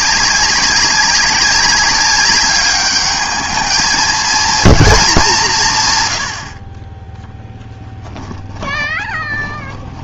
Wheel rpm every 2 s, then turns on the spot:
190, 210, 230, 40, 20.
8-10